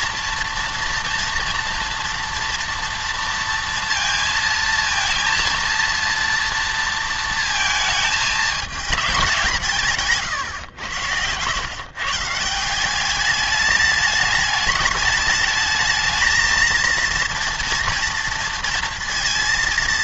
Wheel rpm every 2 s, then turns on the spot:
240, 230, 230, 230, 220, 110, 170, 210, 230, 230.
none